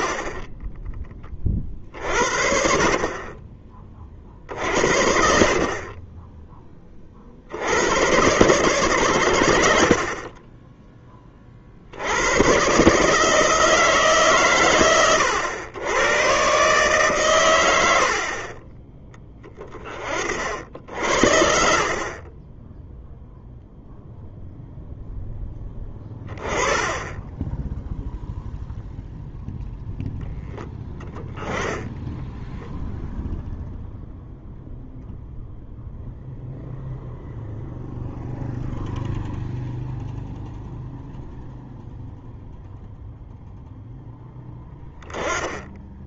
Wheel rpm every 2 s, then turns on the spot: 30, 30, 60, 50, 110, 20, 140, 110, 140, 20, 60, 0, 0, 20, 0, 10, 0, 0, 0, 0, 0, 0, 10.
none